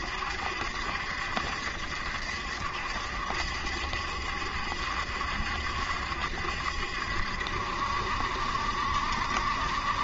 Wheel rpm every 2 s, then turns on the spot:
70, 70, 70, 70, 70.
none